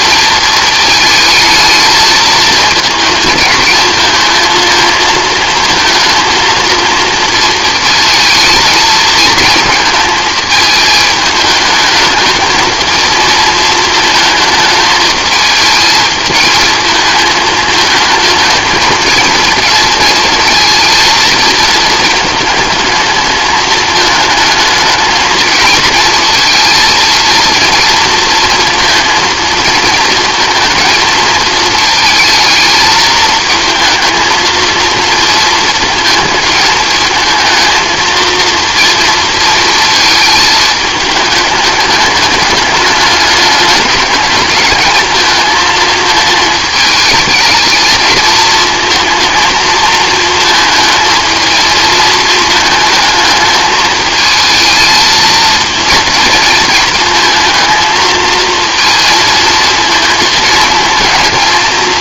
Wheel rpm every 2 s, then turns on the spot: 220, 220, 220, 230, 220, 220, 220, 220, 220, 220, 220, 220, 220, 230, 230, 230, 220, 230, 220, 230, 220, 200, 220, 220, 220, 220, 220, 220, 220, 230, 220.
none